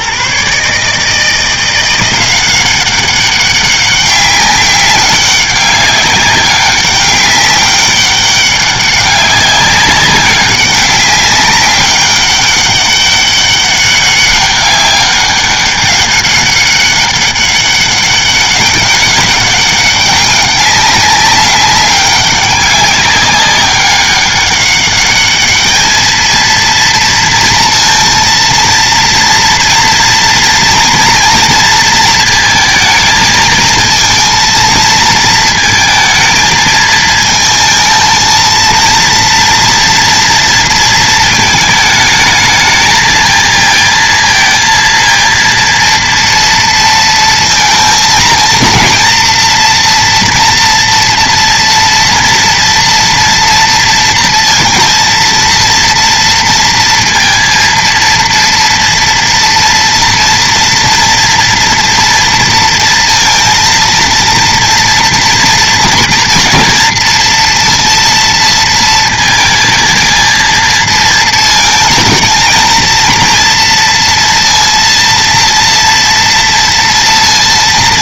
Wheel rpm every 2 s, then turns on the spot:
150, 190, 190, 200, 200, 190, 200, 200, 200, 200, 200, 200, 200, 230, 230, 230, 220, 230, 220, 230, 230, 220, 230, 230, 230, 240, 230, 230, 230, 230, 230, 230, 230, 230, 230, 230, 230, 230, 230.
none